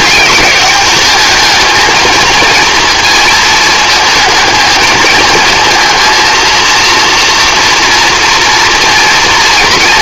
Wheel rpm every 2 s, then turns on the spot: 200, 230, 220, 230, 230.
none